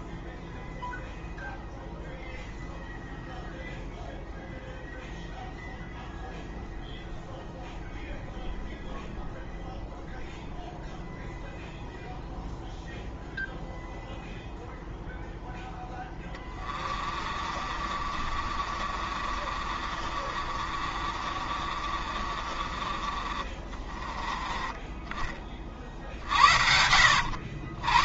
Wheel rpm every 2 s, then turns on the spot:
0, 0, 0, 0, 0, 0, 0, 0, 20, 40, 40, 40, 20, 50.
16-24